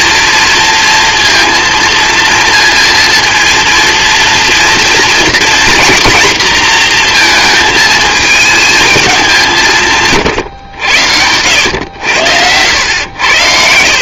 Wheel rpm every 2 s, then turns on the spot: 230, 230, 230, 240, 220, 100, 90.
none